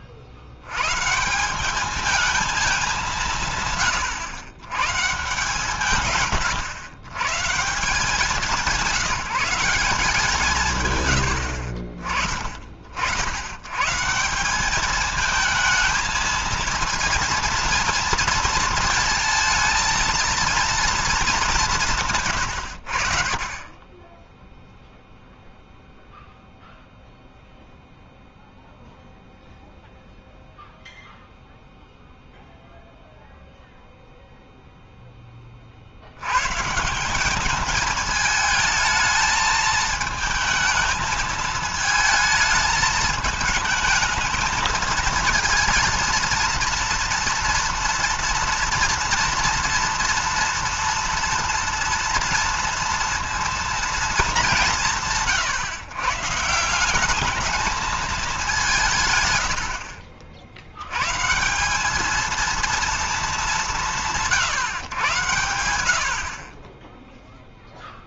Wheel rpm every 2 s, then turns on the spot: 80, 210, 130, 110, 190, 150, 50, 180, 230, 230, 230, 110, 10, 0, 0, 0, 0, 0, 130, 220, 220, 220, 230, 230, 230, 230, 230, 190, 170, 200, 70, 230, 130, 30.
none